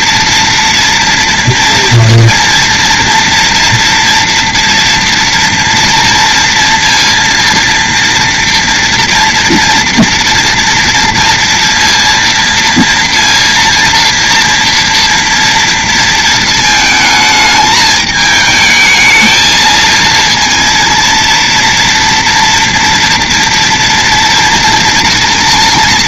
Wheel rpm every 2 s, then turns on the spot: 230, 230, 230, 230, 230, 230, 230, 230, 220, 220, 230, 230, 230.
none